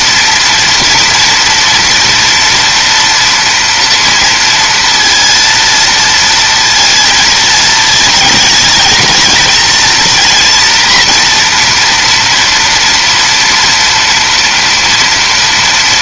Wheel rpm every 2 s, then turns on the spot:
230, 230, 230, 230, 220, 240, 240, 240.
none